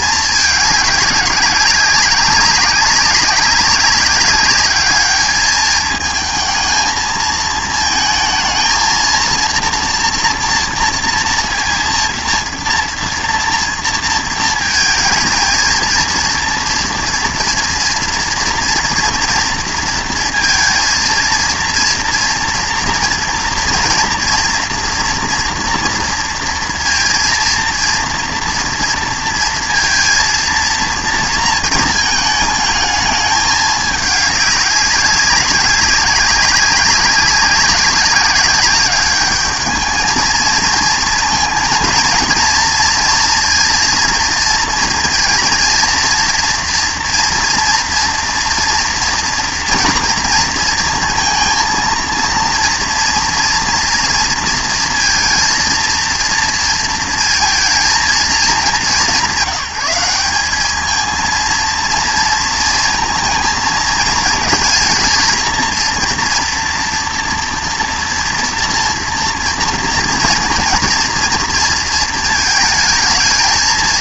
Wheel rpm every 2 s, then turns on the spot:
210, 200, 200, 230, 220, 230, 230, 220, 230, 230, 230, 230, 230, 230, 230, 230, 220, 200, 200, 200, 220, 230, 230, 230, 230, 230, 230, 230, 230, 190, 200, 230, 220, 230, 230, 230, 220.
none